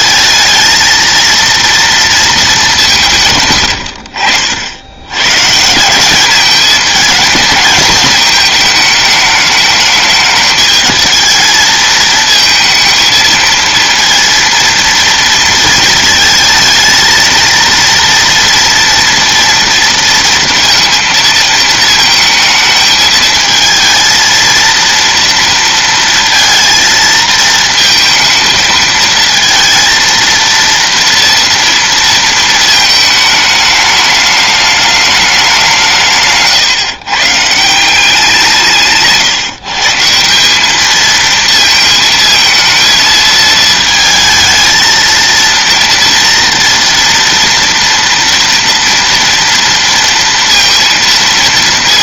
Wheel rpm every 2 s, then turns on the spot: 220, 210, 70, 210, 220, 220, 220, 230, 220, 230, 230, 220, 230, 230, 220, 230, 220, 210, 140, 170, 200, 230, 220, 230, 230, 230.
none